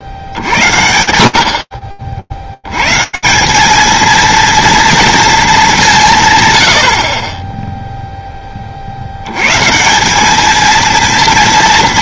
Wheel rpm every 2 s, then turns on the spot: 60, 130, 230, 60, 60, 230.
none